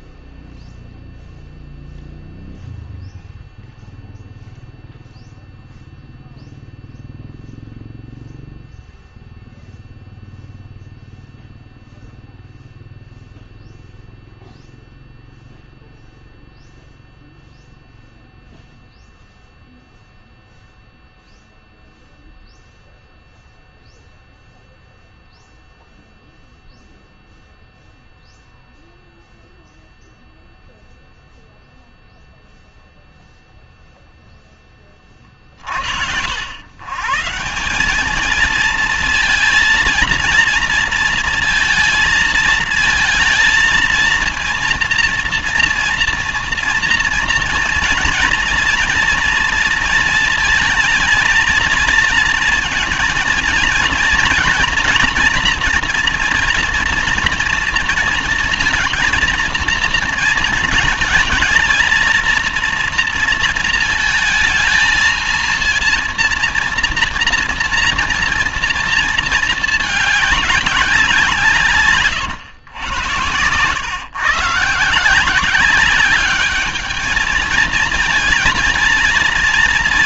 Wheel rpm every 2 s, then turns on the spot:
0, 0, 0, 0, 0, 0, 0, 0, 0, 0, 0, 0, 0, 0, 0, 0, 0, 20, 110, 230, 230, 230, 230, 230, 230, 220, 230, 230, 230, 230, 220, 230, 220, 230, 230, 200, 110, 150, 210, 230.
none